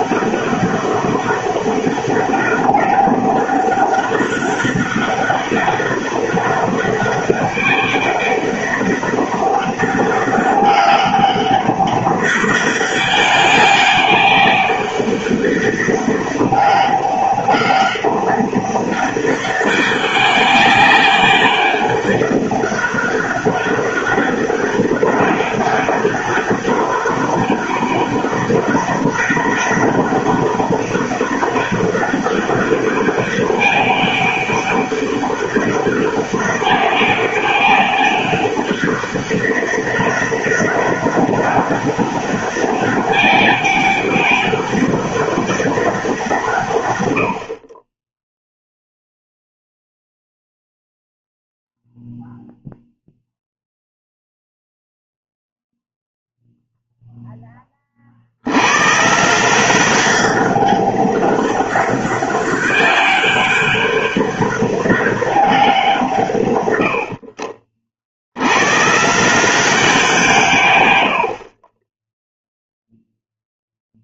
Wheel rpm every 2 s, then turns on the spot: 200, 200, 200, 190, 200, 200, 200, 200, 200, 200, 200, 200, 200, 200, 200, 200, 200, 200, 200, 200, 200, 200, 200, 130, 0, 0, 0, 0, 0, 110, 200, 190, 200, 100, 120, 120, 0.
none